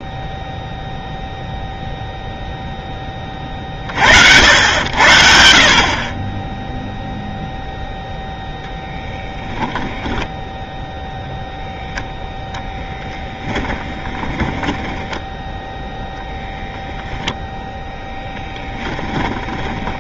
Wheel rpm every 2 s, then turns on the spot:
0, 0, 80, 0, 10, 10, 0, 20, 0, 10.
10-12 14-16 18-20